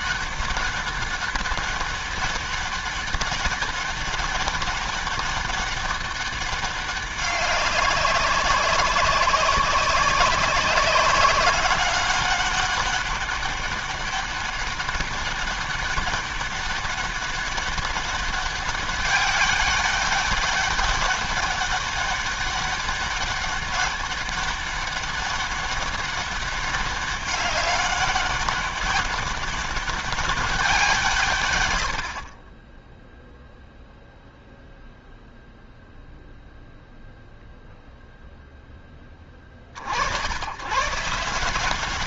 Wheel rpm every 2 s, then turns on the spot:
200, 200, 200, 200, 190, 190, 200, 200, 200, 200, 200, 200, 200, 200, 200, 190, 40, 0, 0, 10, 100.
none